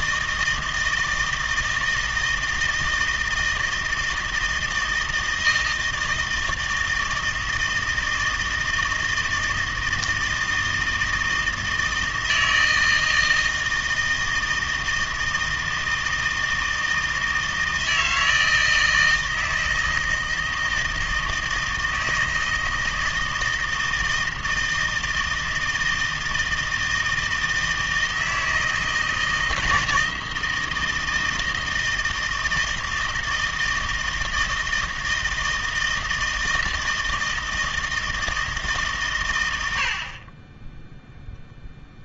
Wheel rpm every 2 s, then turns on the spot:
160, 160, 160, 160, 160, 160, 160, 160, 160, 160, 160, 160, 160, 160, 160, 160, 160, 160, 160, 140, 0.
none